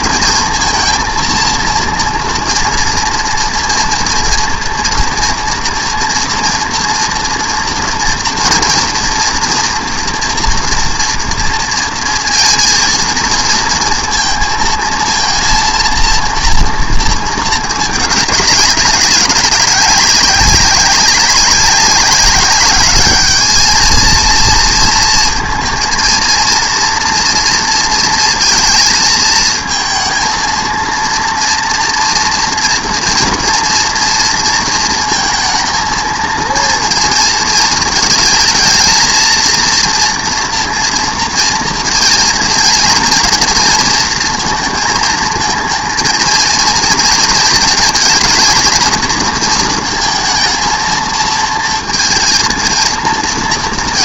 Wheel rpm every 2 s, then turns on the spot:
230, 230, 230, 230, 230, 240, 230, 220, 230, 200, 200, 200, 230, 230, 230, 230, 230, 230, 230, 220, 230, 230, 230, 230, 230, 230, 230.
none